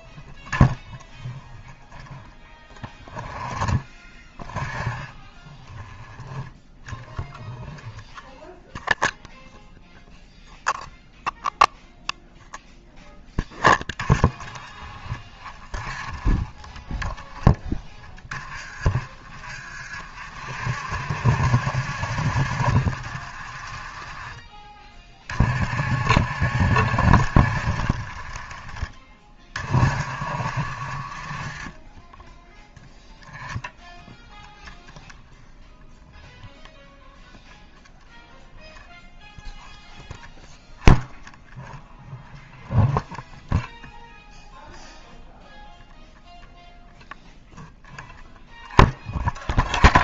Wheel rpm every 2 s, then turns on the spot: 0, 0, 0, 0, 0, 0, 0, 20, 10, 30, 60, 50, 30, 70, 20, 40, 0, 0, 0, 0, 0, 0, 0, 0, 0.
none